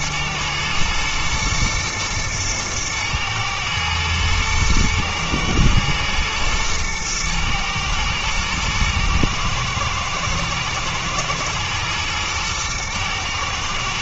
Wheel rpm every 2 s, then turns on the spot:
120, 110, 110, 110, 110, 110, 120.
none